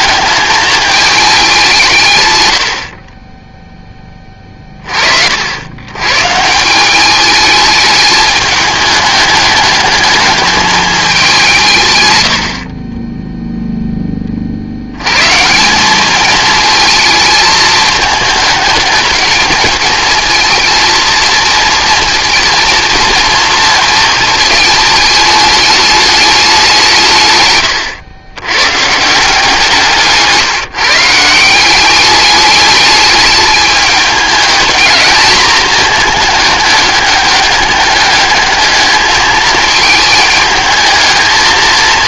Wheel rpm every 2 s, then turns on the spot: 210, 60, 40, 180, 210, 210, 40, 90, 220, 220, 230, 230, 220, 170, 140, 150, 210, 220, 210, 210, 220.
none